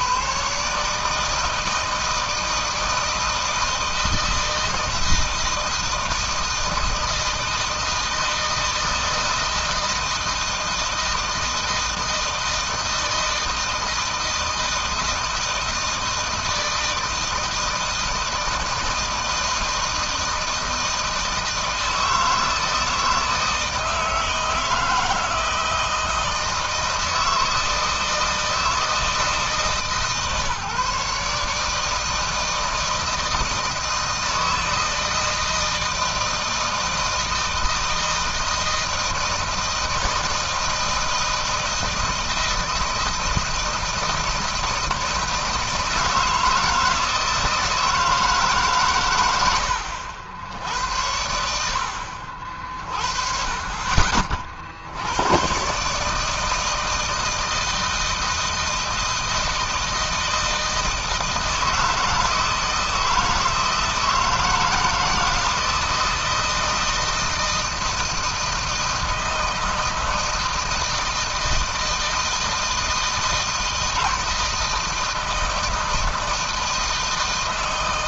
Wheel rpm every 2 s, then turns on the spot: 160, 160, 160, 160, 160, 160, 160, 160, 160, 160, 160, 160, 160, 160, 160, 150, 160, 160, 160, 160, 160, 160, 160, 160, 110, 80, 40, 100, 160, 160, 160, 160, 160, 160, 170, 160, 160, 160, 160.
none